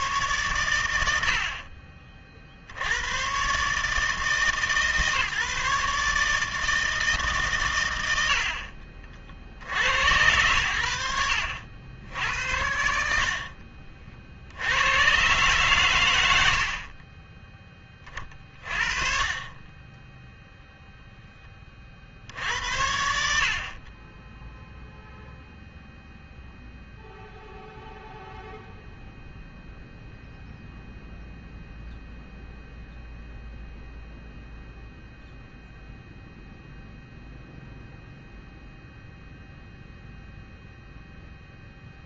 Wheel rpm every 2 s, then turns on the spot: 110, 70, 150, 160, 50, 90, 80, 80, 70, 40, 0, 70, 0, 0, 0, 0, 0, 0, 0, 0, 0.
none